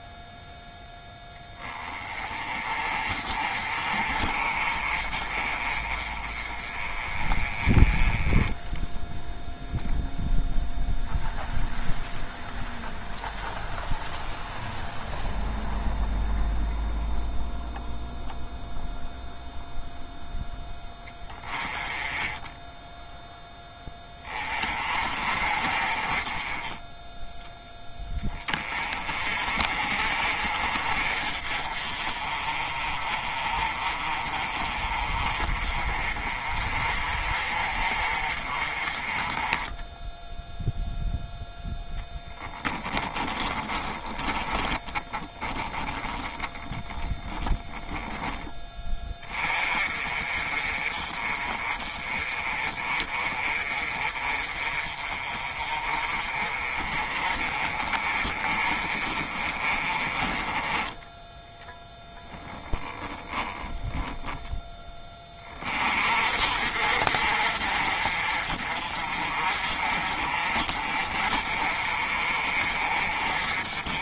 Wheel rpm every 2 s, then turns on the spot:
10, 40, 40, 30, 0, 0, 0, 0, 0, 0, 20, 10, 30, 10, 30, 40, 30, 30, 40, 30, 0, 20, 20, 20, 20, 30, 30, 40, 40, 40, 20, 10, 20, 50, 40, 40, 40.
42-48 62-64